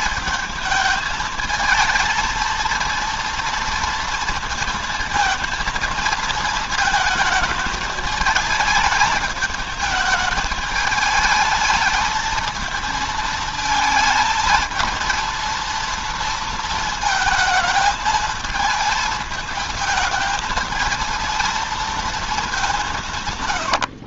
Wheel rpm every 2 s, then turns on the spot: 220, 230, 230, 230, 220, 220, 220, 220, 230, 220, 230, 180.
22-24